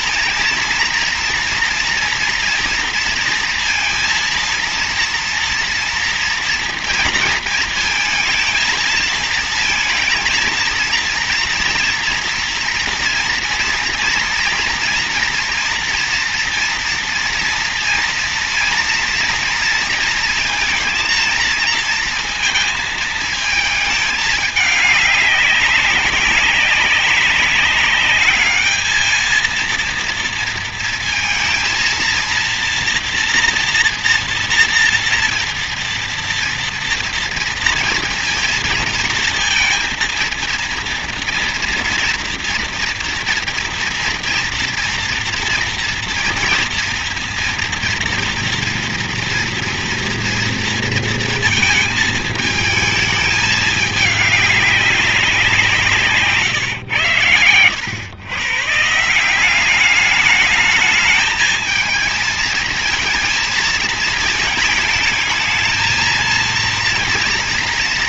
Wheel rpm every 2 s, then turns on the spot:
230, 240, 230, 240, 220, 230, 230, 230, 230, 230, 230, 230, 210, 200, 210, 230, 230, 240, 230, 230, 230, 230, 230, 240, 230, 230, 220, 200, 150, 120, 210, 220, 220, 230.
none